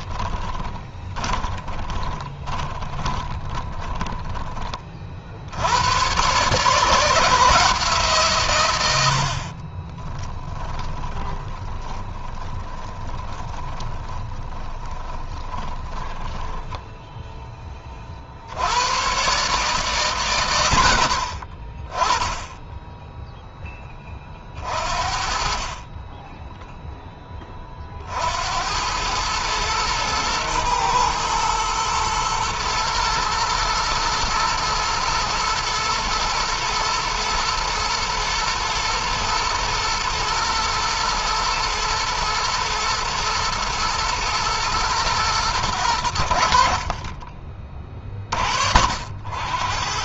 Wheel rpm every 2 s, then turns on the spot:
20, 20, 40, 160, 100, 30, 20, 20, 10, 110, 60, 10, 50, 10, 90, 120, 120, 110, 110, 120, 110, 120, 110, 40, 70.
0-4 10-18